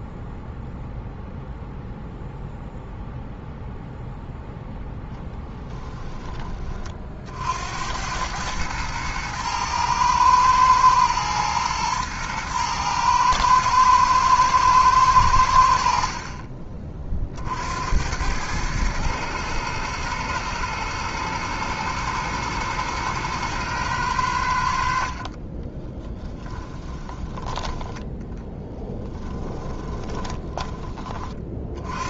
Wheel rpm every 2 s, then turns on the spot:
0, 0, 0, 40, 110, 110, 110, 110, 40, 110, 110, 110, 60, 20, 20, 20.
26-30